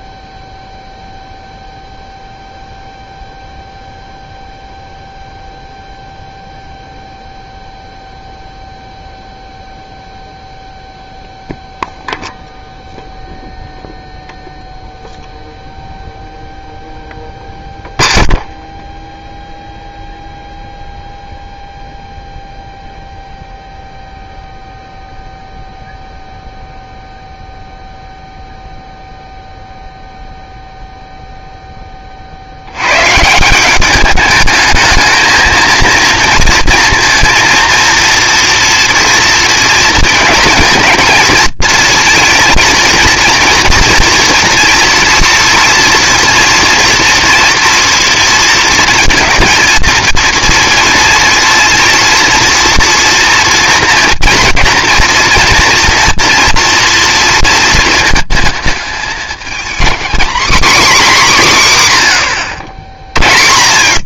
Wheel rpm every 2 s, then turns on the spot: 0, 0, 0, 0, 0, 0, 0, 0, 0, 0, 0, 0, 0, 0, 0, 0, 90, 210, 230, 230, 230, 230, 230, 240, 230, 230, 230, 230, 240, 210, 260, 80.
none